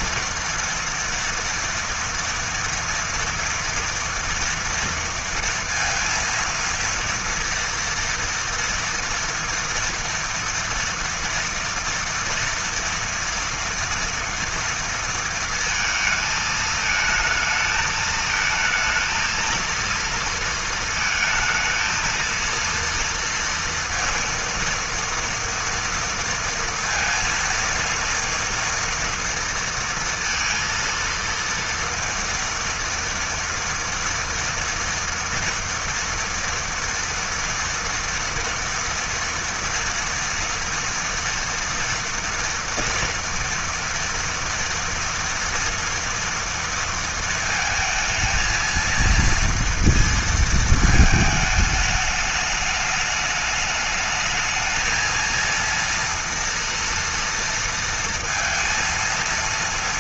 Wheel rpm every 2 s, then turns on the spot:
230, 230, 230, 230, 230, 230, 230, 230, 220, 220, 220, 230, 230, 230, 230, 230, 230, 230, 230, 230, 230, 230, 230, 220, 230, 220, 210, 230, 230, 230.
none